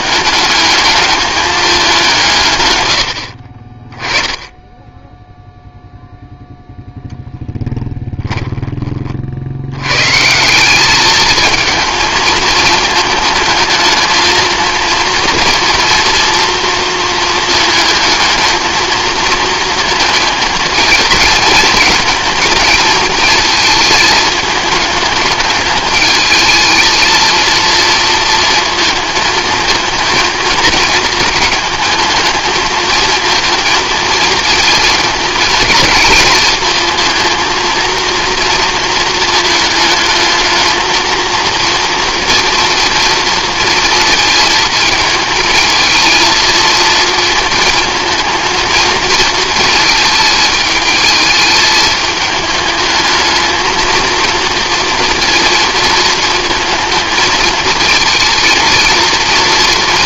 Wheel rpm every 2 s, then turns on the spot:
210, 120, 10, 0, 20, 190, 220, 230, 230, 220, 220, 220, 220, 220, 230, 230, 220, 220, 220, 230, 220, 230, 220, 220, 230, 220, 210, 230, 230, 230.
none